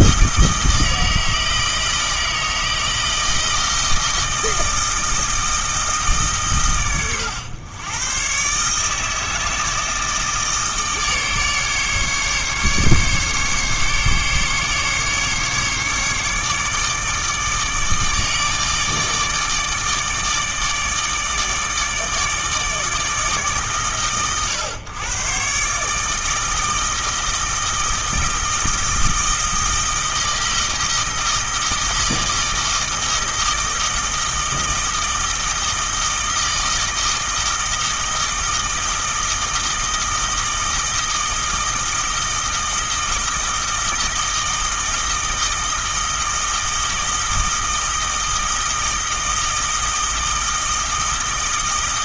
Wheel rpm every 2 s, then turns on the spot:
160, 160, 160, 120, 150, 150, 140, 140, 150, 160, 160, 160, 120, 160, 160, 160, 160, 160, 160, 160, 160, 160, 160, 160, 160, 160.
none